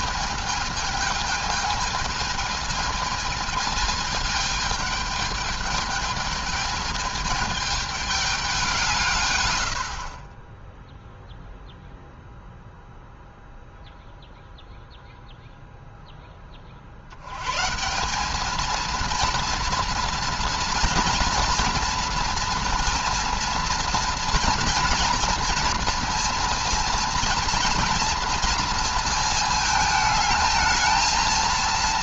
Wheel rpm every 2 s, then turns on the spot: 220, 220, 210, 220, 180, 10, 0, 0, 40, 220, 240, 240, 230, 230, 230, 220.
10-12